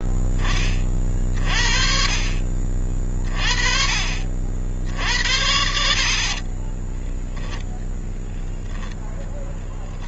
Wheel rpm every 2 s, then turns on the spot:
20, 40, 60, 30, 20.
6-8